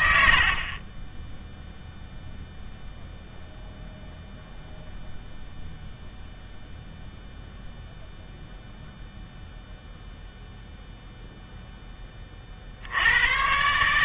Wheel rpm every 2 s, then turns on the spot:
80, 0, 0, 0, 0, 0, 60.
none